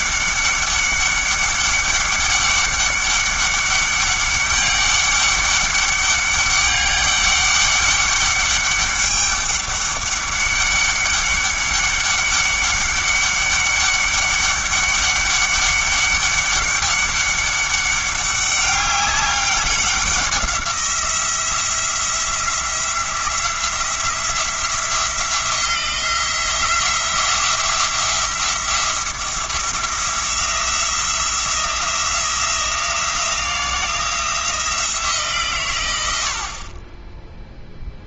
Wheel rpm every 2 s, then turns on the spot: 200, 200, 200, 200, 200, 200, 200, 200, 200, 200, 180, 170, 170, 170, 170, 170, 170, 170, 40.
none